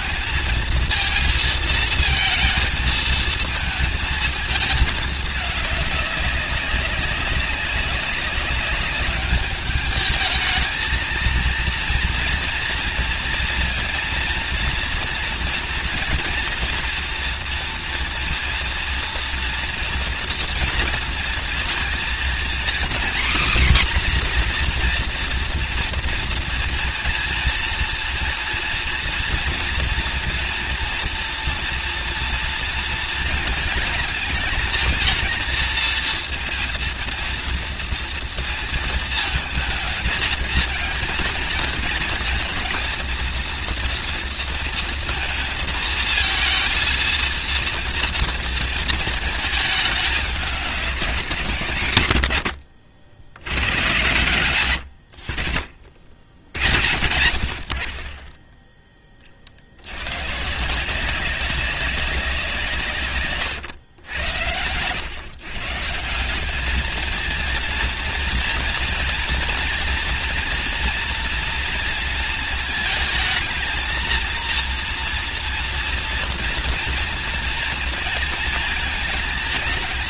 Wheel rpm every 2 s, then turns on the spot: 220, 220, 210, 190, 200, 220, 230, 230, 240, 240, 230, 250, 250, 230, 230, 230, 230, 220, 230, 230, 230, 230, 230, 230, 230, 200, 80, 100, 60, 10, 160, 160, 90, 210, 230, 240, 220, 230, 230, 220.
none